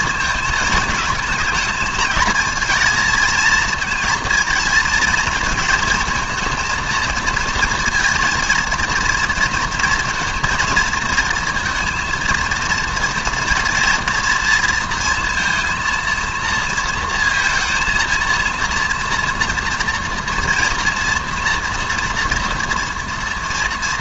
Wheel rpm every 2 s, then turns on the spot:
220, 230, 230, 230, 230, 230, 230, 230, 230, 230, 230, 240.
none